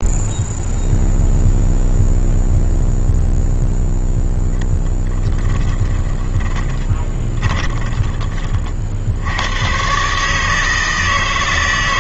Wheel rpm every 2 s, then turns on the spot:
0, 0, 10, 20, 50, 160.
4-8